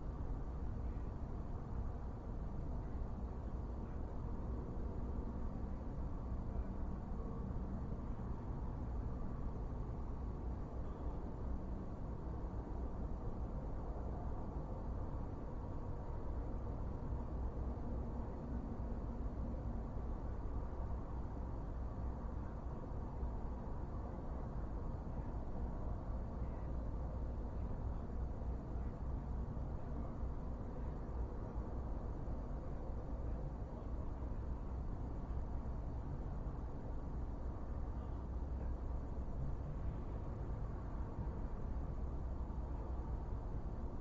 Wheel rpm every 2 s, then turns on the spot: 0, 0, 0, 0, 0, 0, 0, 0, 0, 0, 0, 0, 0, 0, 0, 0, 0, 0, 0, 0, 0, 0.
none